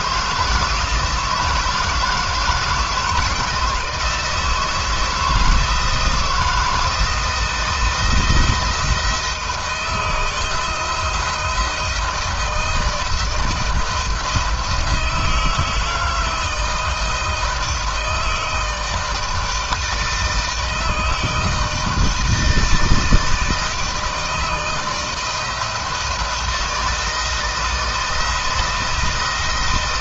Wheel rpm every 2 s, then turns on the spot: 170, 160, 160, 160, 170, 170, 160, 170, 160, 160, 160, 160, 160, 170, 170.
none